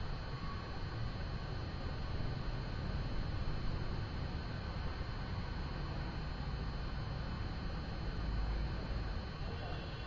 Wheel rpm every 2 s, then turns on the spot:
0, 0, 0, 0, 0.
none